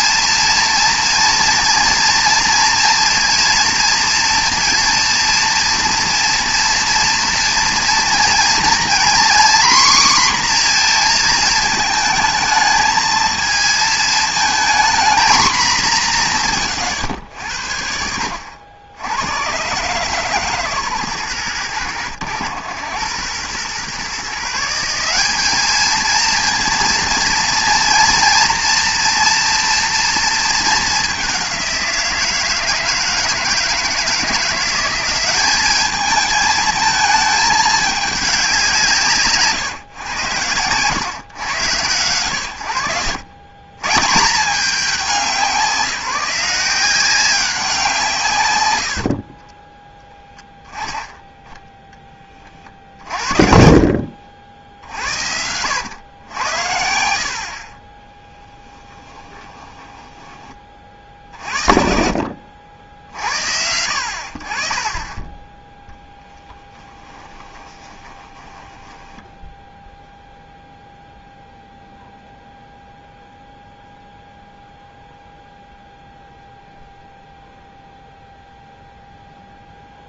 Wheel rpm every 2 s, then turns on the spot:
230, 230, 230, 230, 240, 240, 220, 230, 140, 70, 130, 100, 180, 230, 240, 210, 160, 180, 220, 170, 110, 70, 180, 170, 110, 10, 50, 60, 80, 10, 30, 70, 40, 10, 10, 0, 0, 0, 0, 0.
54-56 58-60 66-70